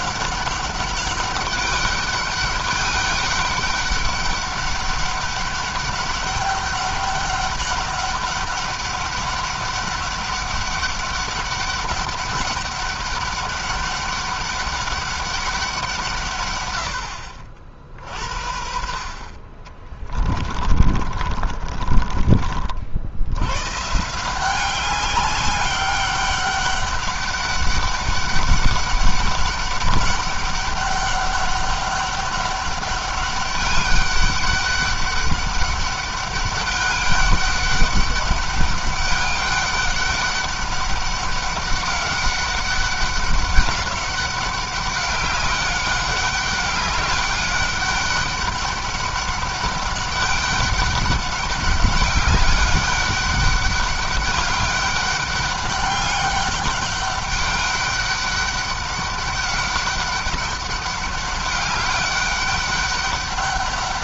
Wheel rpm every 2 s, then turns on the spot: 200, 200, 200, 200, 200, 200, 200, 200, 90, 60, 50, 50, 190, 200, 200, 200, 200, 200, 200, 200, 200, 200, 200, 200, 200, 200, 200, 200, 200, 200, 200, 200.
20-22